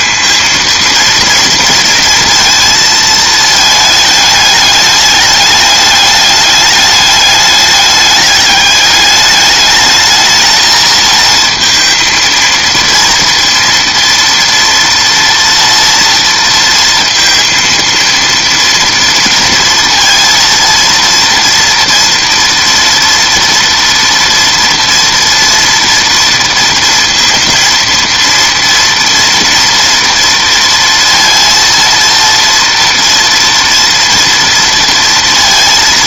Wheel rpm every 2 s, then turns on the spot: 220, 230, 210, 210, 200, 220, 230, 230, 230, 230, 230, 230, 230, 230, 230, 230, 230, 230.
none